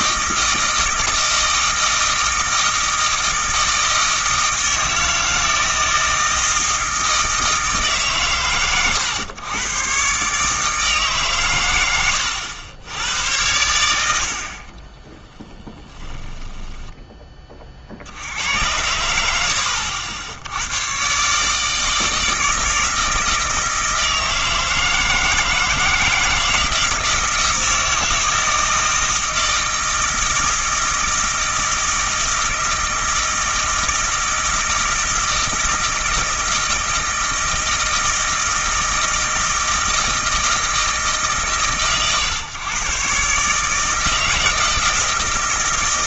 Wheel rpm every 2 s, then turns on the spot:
160, 160, 160, 160, 120, 150, 90, 40, 10, 90, 100, 160, 160, 160, 160, 160, 160, 160, 160, 160, 160, 130, 160.
14-18